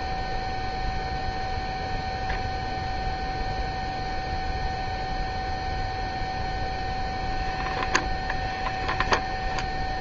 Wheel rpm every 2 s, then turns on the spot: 0, 0, 0, 0, 0.
none